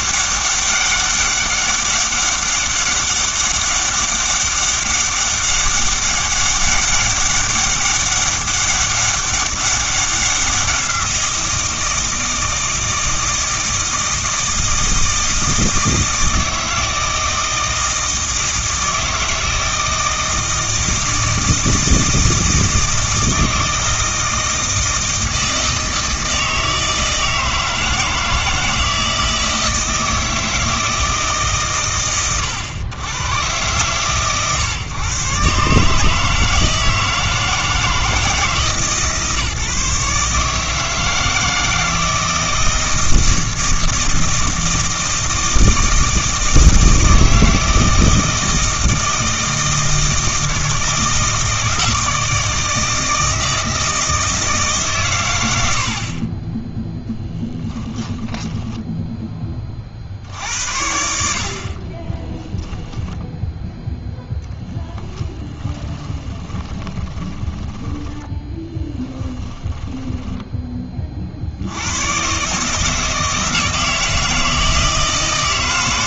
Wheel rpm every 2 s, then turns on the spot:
200, 200, 200, 200, 200, 180, 160, 160, 160, 160, 160, 160, 160, 160, 160, 160, 110, 120, 160, 150, 150, 160, 160, 160, 160, 160, 160, 140, 0, 10, 70, 10, 0, 20, 10, 20, 150, 160.
58-60 62-64 66-70